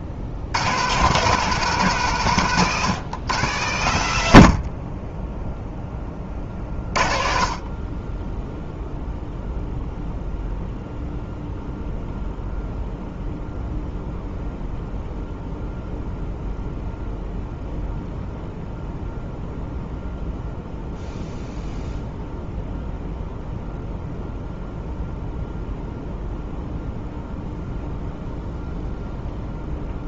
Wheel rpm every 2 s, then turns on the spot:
70, 150, 80, 30, 0, 0, 0, 0, 0, 0, 0, 0, 0, 0, 0.
none